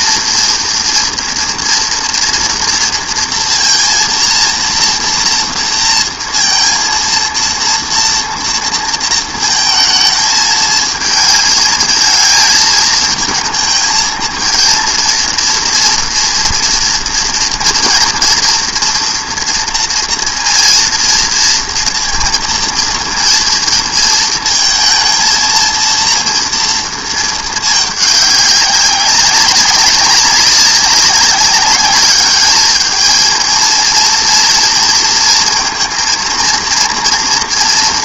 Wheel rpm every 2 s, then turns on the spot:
230, 230, 230, 230, 230, 220, 220, 220, 230, 240, 230, 230, 220, 230, 200, 190, 220, 230, 230.
none